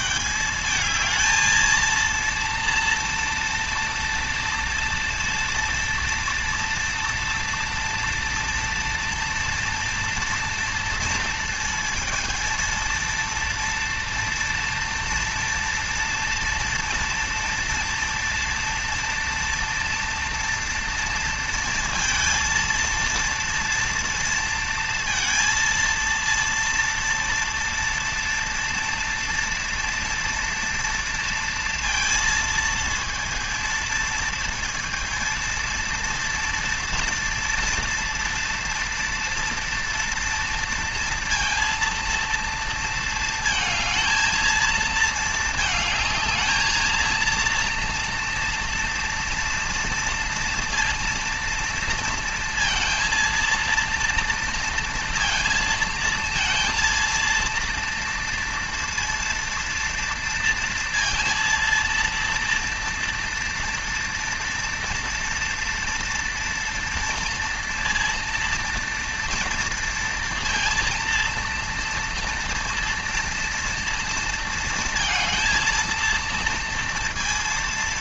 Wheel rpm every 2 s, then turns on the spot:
220, 230, 230, 230, 230, 230, 230, 230, 230, 240, 230, 230, 230, 230, 230, 230, 230, 230, 230, 240, 230, 230, 220, 220, 230, 230, 230, 230, 230, 230, 230, 230, 240, 230, 230, 230, 230, 230, 230.
none